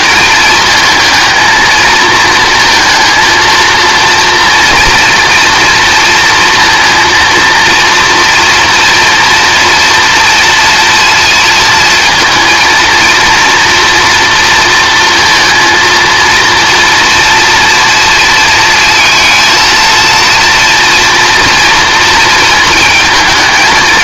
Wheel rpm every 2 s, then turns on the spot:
220, 230, 240, 230, 240, 230, 230, 230, 230, 230, 240, 220.
none